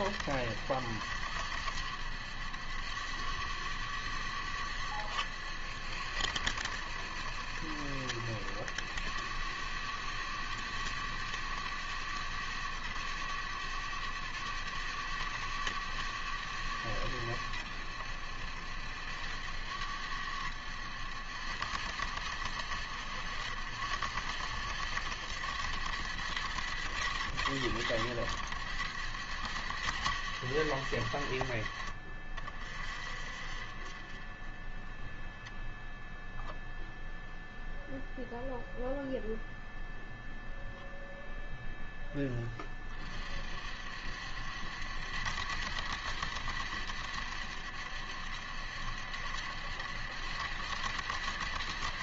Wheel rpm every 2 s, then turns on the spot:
80, 90, 80, 70, 90, 100, 100, 100, 90, 80, 80, 80, 90, 80, 80, 80, 50, 20, 0, 0, 0, 30, 70, 80, 70, 80.
none